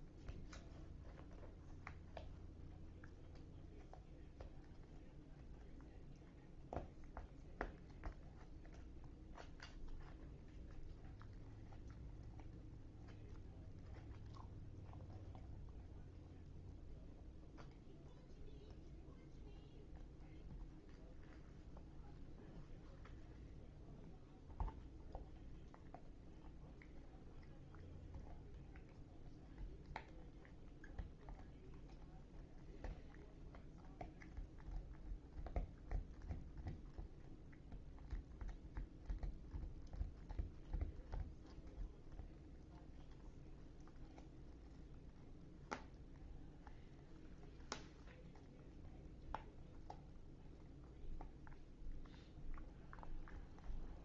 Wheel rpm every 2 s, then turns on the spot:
0, 0, 0, 0, 0, 0, 0, 0, 0, 0, 0, 0, 0, 0, 0, 0, 0, 0, 0, 0, 0, 0, 0, 0, 0, 0, 0.
none